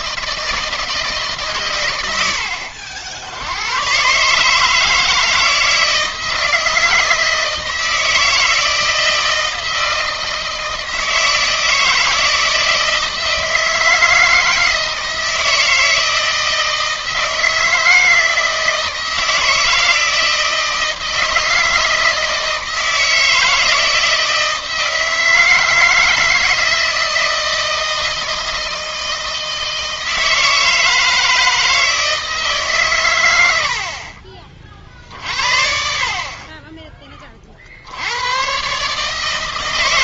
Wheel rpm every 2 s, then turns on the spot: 160, 60, 160, 160, 160, 160, 160, 160, 160, 160, 160, 160, 160, 160, 160, 160, 140, 50, 20, 140.
none